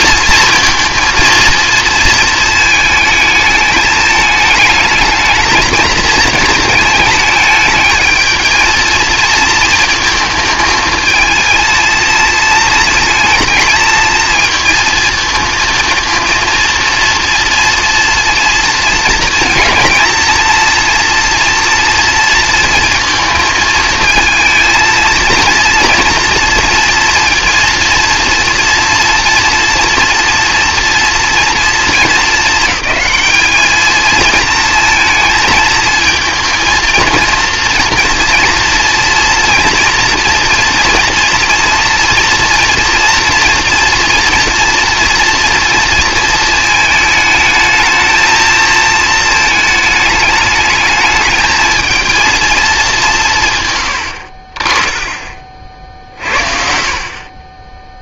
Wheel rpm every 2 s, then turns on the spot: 230, 220, 210, 220, 220, 220, 230, 230, 230, 230, 230, 230, 220, 230, 230, 230, 210, 230, 230, 230, 240, 230, 230, 220, 220, 220, 220, 40, 50.
none